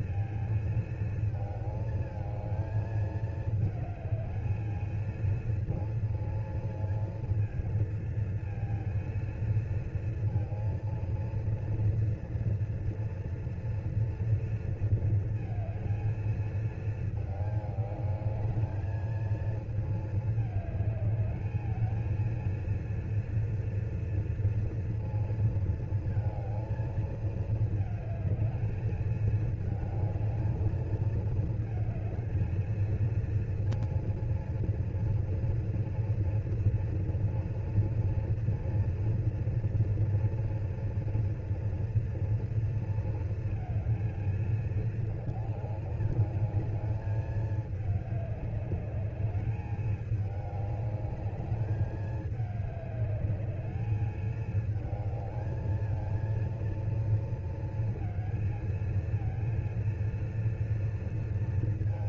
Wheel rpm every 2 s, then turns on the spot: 230, 220, 220, 230, 230, 230, 240, 230, 220, 210, 210, 230, 230, 220, 220, 210, 220, 230, 230, 230, 230, 230, 220, 210, 200, 200, 210, 210, 220, 220, 230.
none